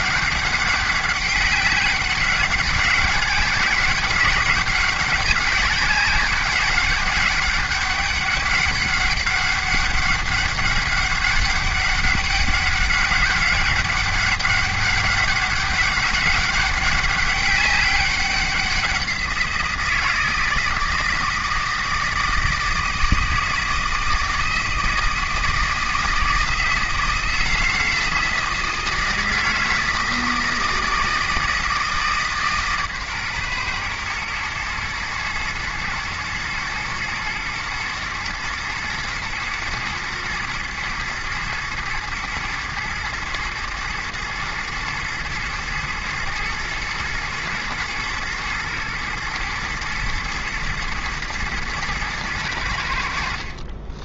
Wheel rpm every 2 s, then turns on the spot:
190, 200, 200, 200, 200, 200, 190, 200, 200, 190, 160, 160, 160, 160, 160, 160, 140, 110, 110, 120, 120, 110, 110, 110, 110, 110, 70.
none